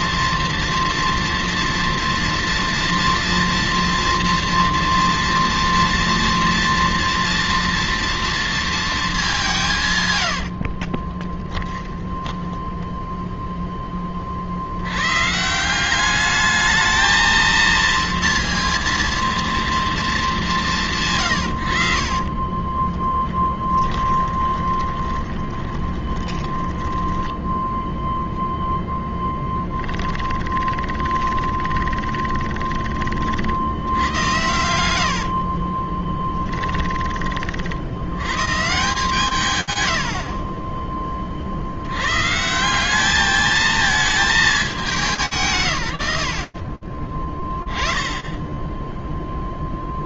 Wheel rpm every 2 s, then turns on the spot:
230, 230, 240, 230, 210, 30, 10, 90, 220, 230, 160, 10, 20, 10, 0, 20, 30, 90, 20, 140, 30, 180, 180, 30, 0.
10-14 22-28 30-32 34-36 46-48